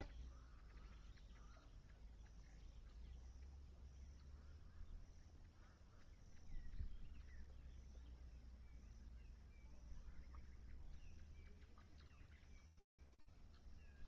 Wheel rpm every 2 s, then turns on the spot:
0, 0, 0, 0, 0, 0, 0.
none